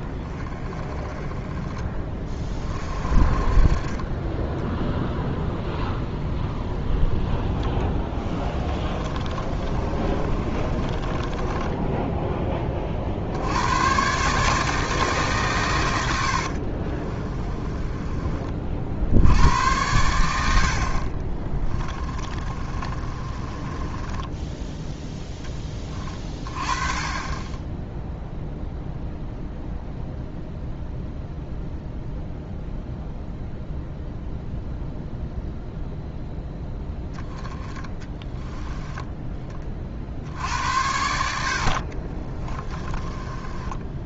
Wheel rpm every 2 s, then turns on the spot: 20, 30, 10, 20, 30, 30, 20, 150, 40, 50, 60, 30, 10, 30, 0, 0, 0, 0, 10, 10, 70, 30.
4-12 16-18 22-24 42-44